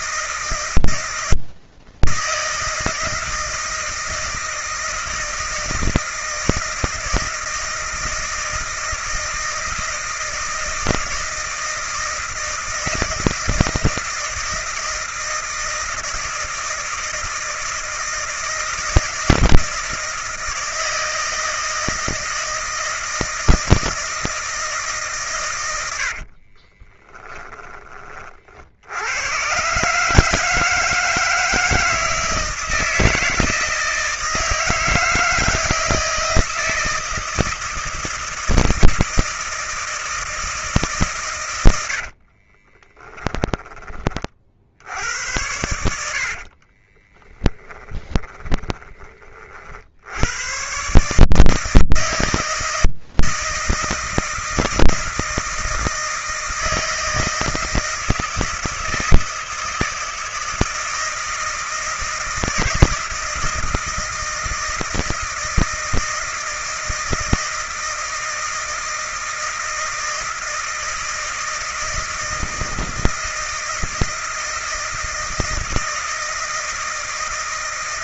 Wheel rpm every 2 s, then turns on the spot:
160, 160, 160, 160, 160, 160, 160, 160, 160, 160, 160, 160, 160, 30, 60, 150, 160, 160, 160, 160, 160, 30, 70, 40, 30, 120, 160, 170, 160, 160, 160, 160, 160, 160, 160, 160, 160, 160, 160.
26-28 42-44 46-48